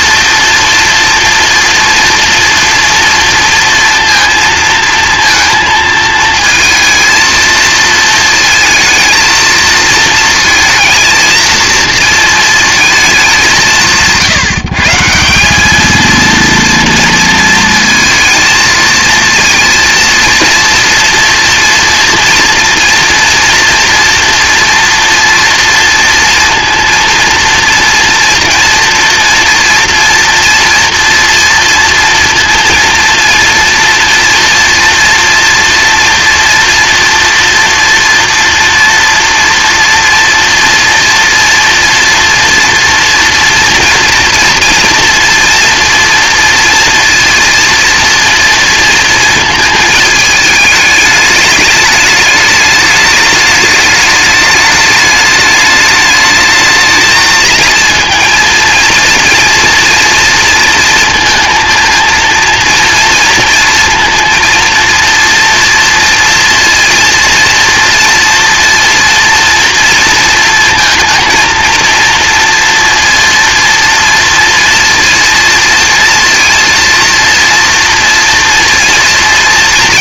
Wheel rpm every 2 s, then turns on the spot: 230, 230, 230, 220, 220, 230, 230, 150, 230, 220, 240, 240, 230, 230, 230, 230, 230, 230, 230, 230, 230, 230, 230, 230, 230, 210, 210, 210, 220, 230, 230, 230, 230, 230, 230, 220, 230, 230, 230, 230.
none